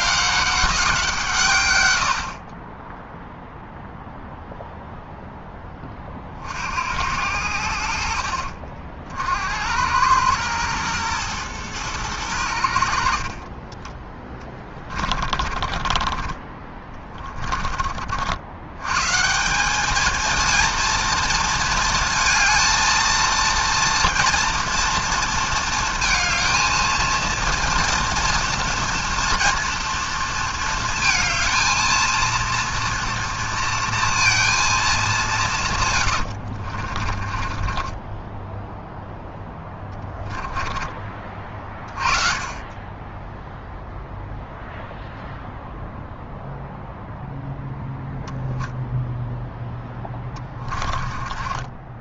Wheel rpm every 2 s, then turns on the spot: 190, 20, 0, 60, 50, 110, 90, 20, 20, 90, 220, 220, 230, 220, 230, 230, 230, 230, 60, 10, 20, 30, 0, 0, 0, 20.
14-16 36-42 50-52